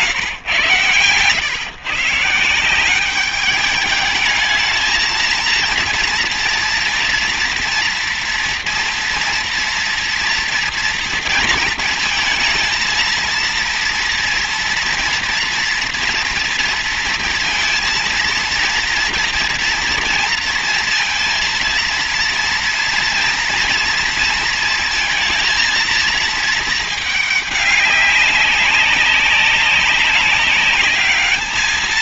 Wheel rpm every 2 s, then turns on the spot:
130, 200, 220, 230, 240, 230, 230, 240, 230, 230, 230, 230, 230, 210, 190, 210.
none